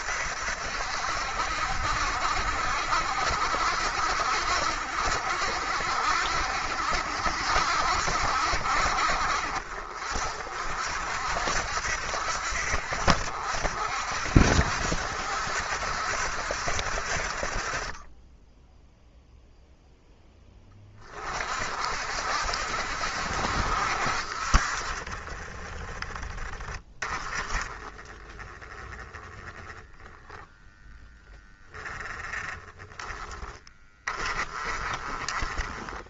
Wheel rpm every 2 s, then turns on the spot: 70, 60, 70, 70, 60, 60, 70, 70, 60, 10, 20, 60, 40, 20, 10, 0, 10, 20.
none